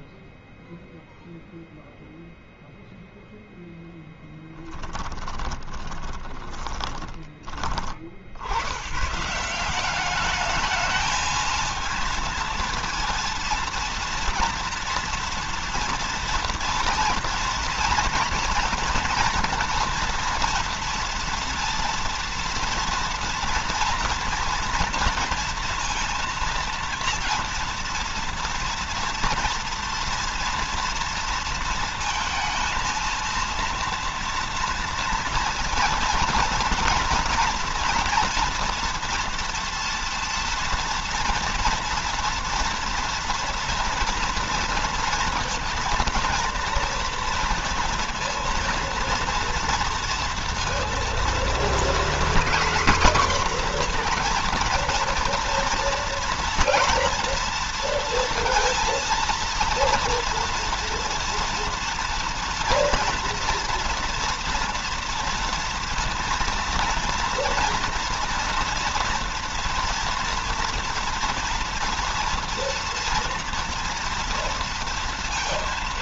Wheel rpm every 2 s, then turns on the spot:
0, 0, 10, 20, 100, 210, 230, 230, 230, 230, 230, 230, 230, 230, 240, 230, 230, 230, 240, 230, 230, 230, 230, 230, 230, 230, 250, 230, 230, 230, 230, 230, 240, 230, 230, 230, 240, 230.
4-8